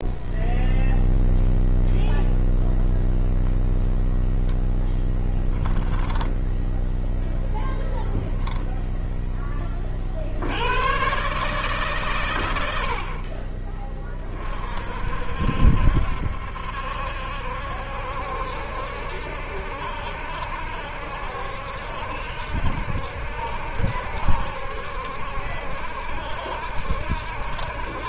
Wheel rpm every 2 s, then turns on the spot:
0, 0, 10, 10, 10, 110, 70, 50, 70, 70, 70, 70, 70, 70.
4-6